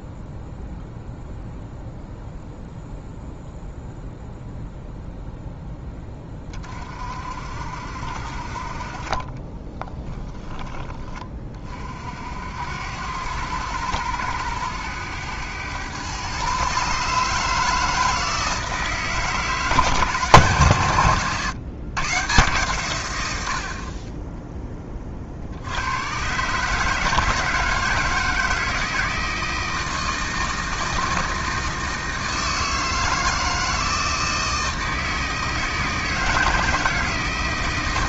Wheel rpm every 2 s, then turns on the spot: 0, 0, 0, 40, 40, 20, 80, 100, 140, 160, 140, 130, 20, 150, 160, 160, 160, 160, 160.
none